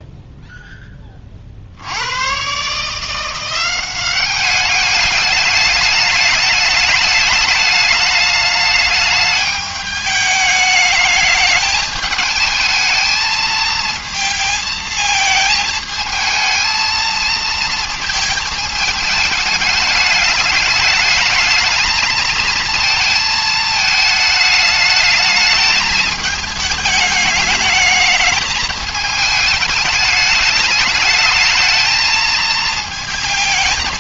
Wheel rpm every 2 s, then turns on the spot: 10, 140, 200, 210, 210, 210, 220, 220, 220, 220, 210, 220, 210, 210, 210, 210, 220.
none